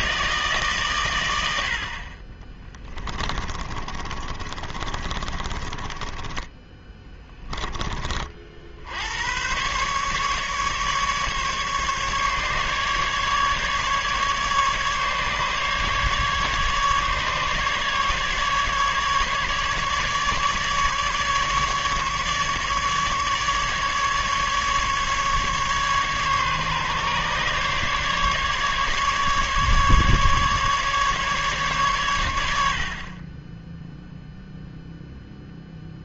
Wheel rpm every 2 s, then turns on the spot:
140, 20, 30, 10, 70, 150, 150, 150, 140, 150, 150, 150, 150, 140, 150, 140, 70, 0.
2-8